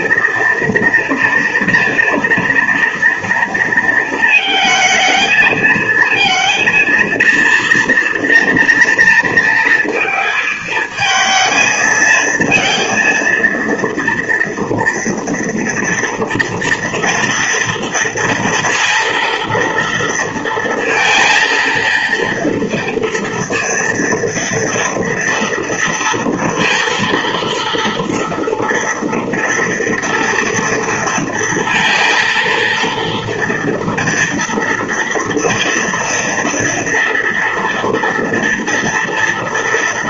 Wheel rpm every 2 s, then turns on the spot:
230, 230, 220, 230, 230, 230, 230, 230, 230, 230, 230, 230, 230, 230, 240, 230, 230, 230, 230, 230.
none